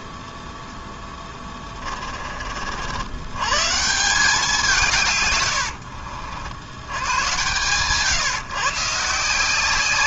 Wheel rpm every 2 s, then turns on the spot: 10, 80, 140, 100, 150.
0-2